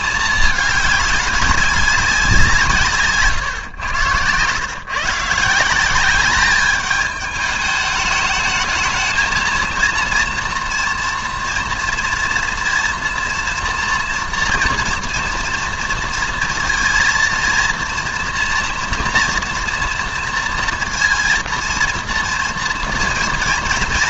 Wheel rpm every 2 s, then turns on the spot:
210, 160, 120, 210, 210, 230, 230, 240, 230, 230, 230, 230.
none